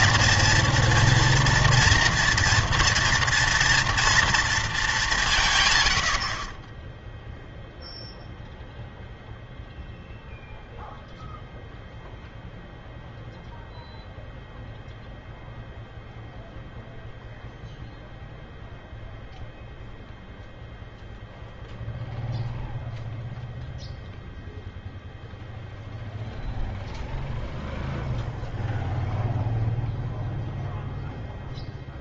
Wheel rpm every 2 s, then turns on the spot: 230, 230, 220, 20, 0, 0, 0, 0, 0, 0, 0, 0, 0, 0, 0, 0.
none